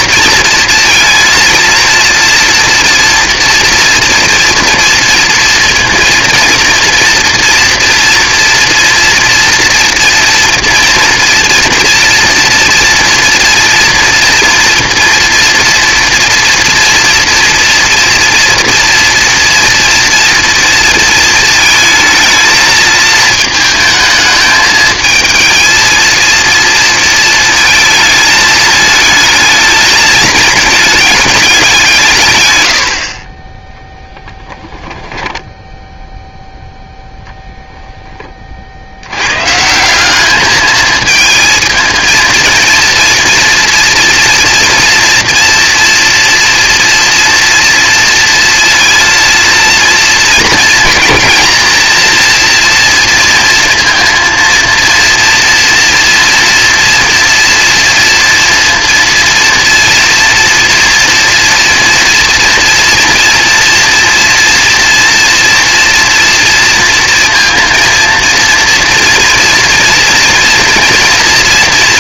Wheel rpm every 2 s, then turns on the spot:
230, 230, 230, 230, 230, 230, 240, 230, 240, 230, 230, 220, 220, 230, 220, 220, 100, 10, 0, 50, 210, 230, 230, 230, 230, 230, 230, 230, 240, 240, 230, 230, 240, 230, 230, 230.
34-36